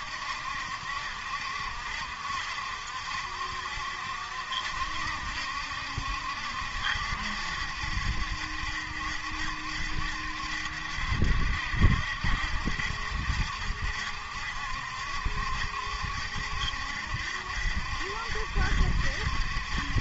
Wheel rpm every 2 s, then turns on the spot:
70, 70, 70, 70, 70, 70, 70, 70, 70, 70.
none